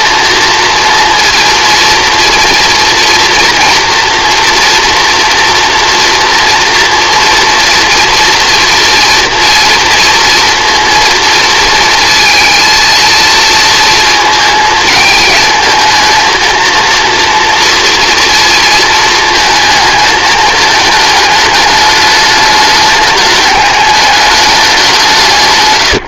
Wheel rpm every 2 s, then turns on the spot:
230, 230, 240, 230, 230, 230, 230, 220, 230, 230, 220, 210, 190.
none